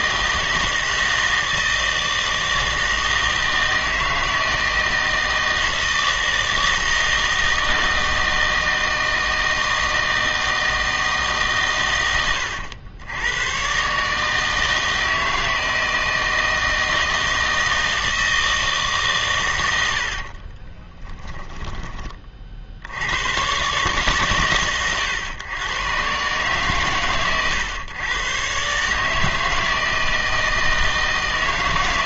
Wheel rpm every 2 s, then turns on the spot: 160, 160, 160, 160, 160, 160, 90, 160, 160, 160, 30, 60, 120, 120, 140, 160.
20-22